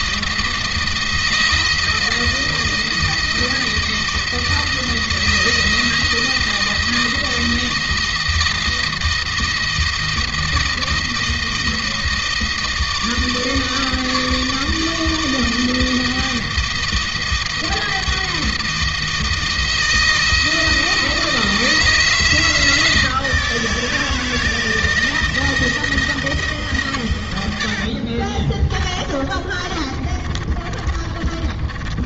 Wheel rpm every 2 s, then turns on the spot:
170, 160, 160, 160, 170, 170, 160, 160, 160, 160, 160, 160, 160, 140, 30, 40.
28-32